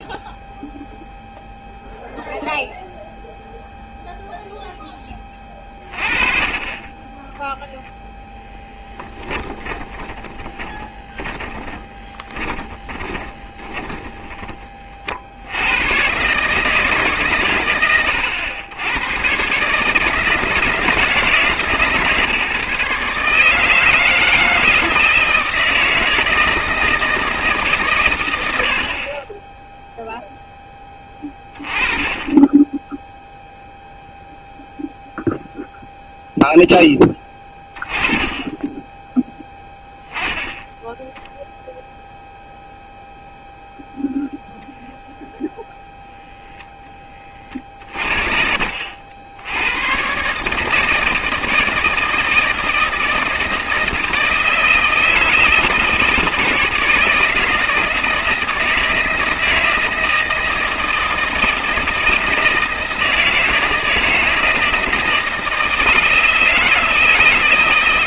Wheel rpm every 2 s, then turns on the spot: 0, 0, 10, 20, 10, 20, 20, 40, 150, 100, 160, 150, 160, 160, 70, 10, 10, 0, 10, 10, 0, 0, 0, 10, 70, 160, 160, 160, 160, 160, 160, 160, 160, 160.
8-14